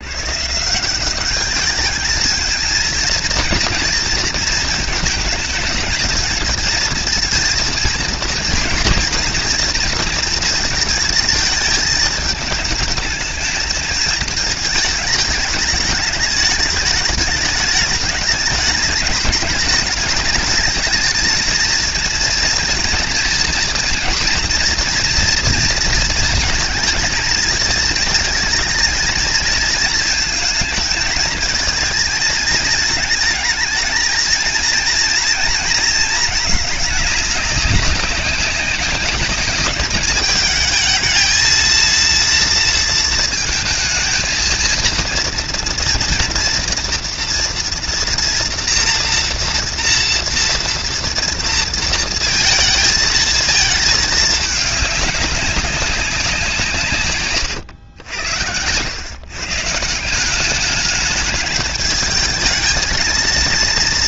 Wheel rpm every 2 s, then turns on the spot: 200, 220, 220, 230, 230, 230, 220, 220, 210, 210, 220, 230, 230, 220, 220, 220, 220, 230, 210, 200, 220, 230, 230, 230, 240, 230, 220, 200, 130, 110, 210, 220.
none